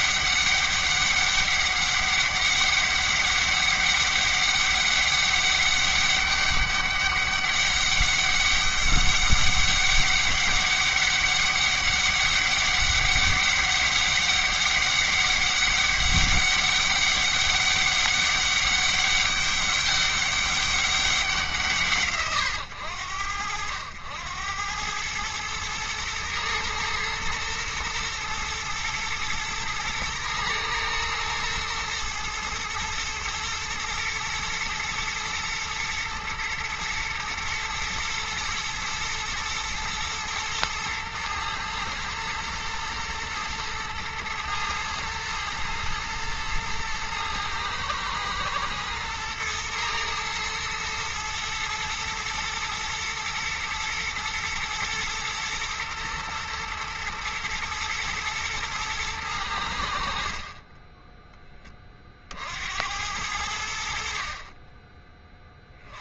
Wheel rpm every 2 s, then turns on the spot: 200, 200, 200, 200, 200, 200, 200, 200, 200, 200, 190, 90, 100, 110, 120, 110, 110, 120, 110, 120, 110, 110, 110, 110, 110, 110, 120, 120, 120, 110, 20, 70, 30.
none